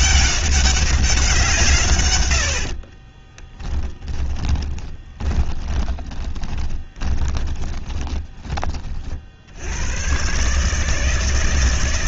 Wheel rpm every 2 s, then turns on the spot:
190, 70, 20, 10, 30, 140.
2-8